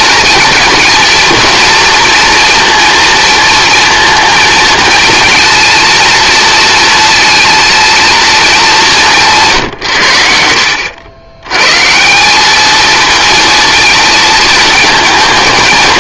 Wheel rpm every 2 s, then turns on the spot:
230, 230, 230, 230, 210, 80, 210, 220.
none